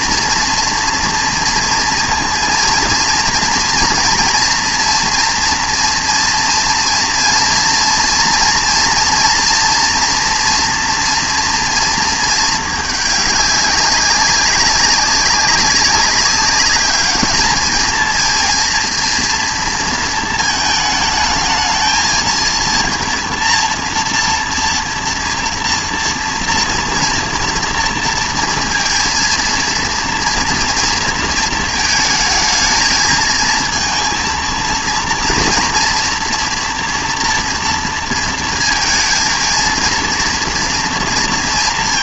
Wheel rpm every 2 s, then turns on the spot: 240, 230, 230, 230, 240, 230, 210, 190, 200, 230, 220, 230, 230, 230, 230, 230, 220, 230, 230, 230, 230.
none